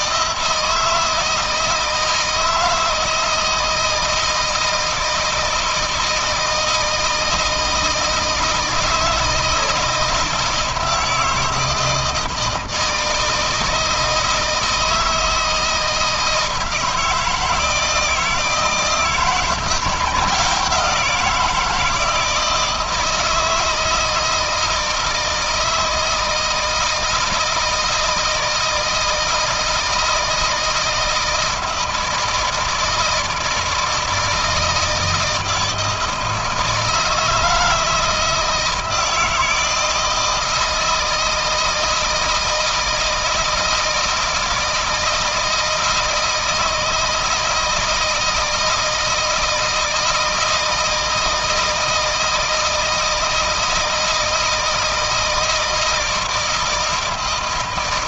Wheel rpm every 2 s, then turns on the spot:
160, 160, 160, 160, 160, 160, 160, 160, 160, 160, 170, 160, 160, 160, 160, 160, 160, 160, 170, 160, 160, 160, 160, 160, 160, 160, 160, 160, 160.
none